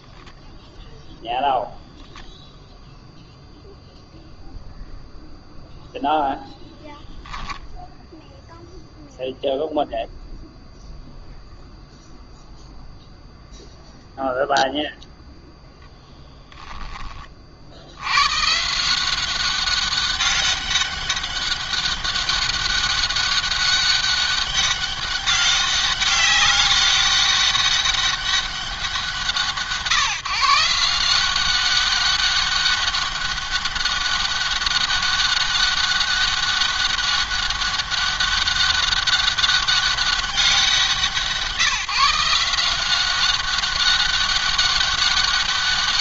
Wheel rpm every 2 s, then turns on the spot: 0, 0, 0, 10, 0, 0, 0, 0, 10, 160, 200, 200, 200, 200, 190, 170, 200, 200, 200, 200, 180, 180, 200.
none